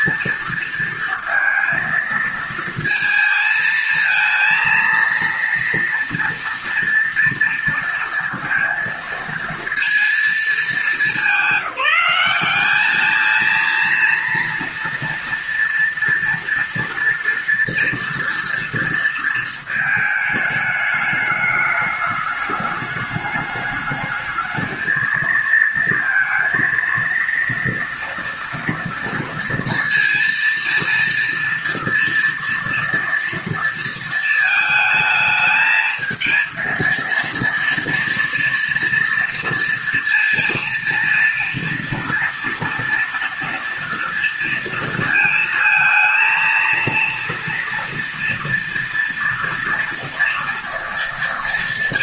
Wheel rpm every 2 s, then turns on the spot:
230, 220, 230, 230, 230, 210, 210, 230, 230, 230, 210, 210, 220, 230, 230, 230, 230, 220, 230, 230, 230, 230, 230, 230, 230, 230.
none